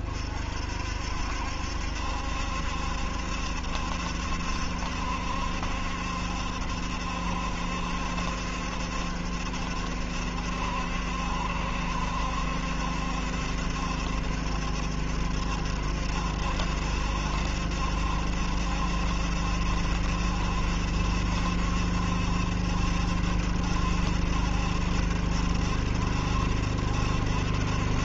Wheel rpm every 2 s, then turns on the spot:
60, 70, 70, 70, 70, 70, 70, 70, 70, 70, 70, 70, 70, 70.
none